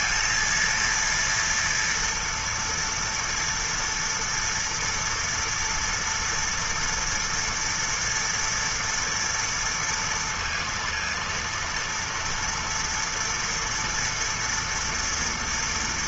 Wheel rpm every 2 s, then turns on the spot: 230, 230, 230, 230, 230, 230, 230, 240.
none